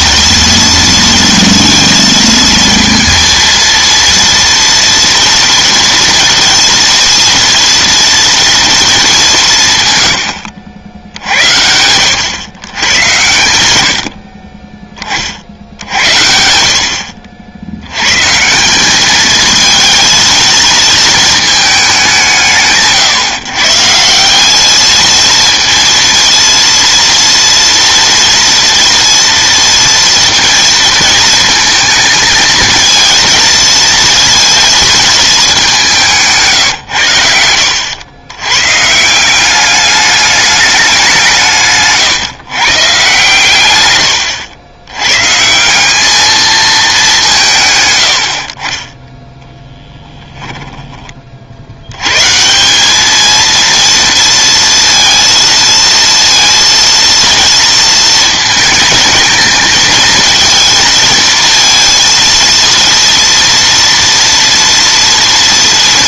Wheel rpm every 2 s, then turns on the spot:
230, 230, 230, 230, 220, 80, 110, 30, 60, 200, 220, 150, 220, 230, 230, 230, 220, 220, 120, 150, 190, 140, 110, 210, 20, 20, 200, 230, 230, 220, 230, 230, 230.
none